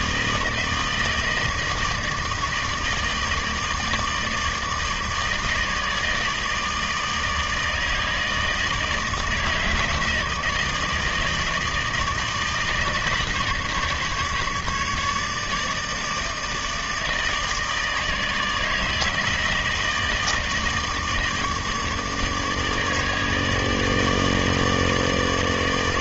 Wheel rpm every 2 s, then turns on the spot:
160, 160, 160, 160, 160, 160, 160, 150, 160, 160, 160, 150, 150.
none